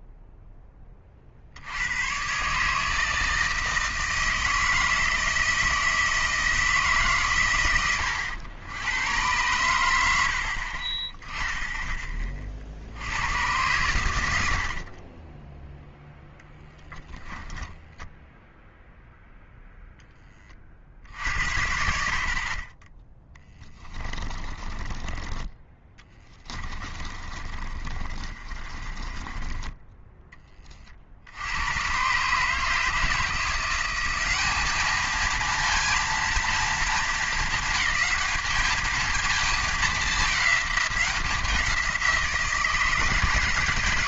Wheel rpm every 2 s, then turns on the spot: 10, 150, 160, 160, 100, 50, 50, 60, 0, 0, 40, 30, 30, 30, 40, 30, 150, 210, 230, 220, 200, 160.
14-16 24-30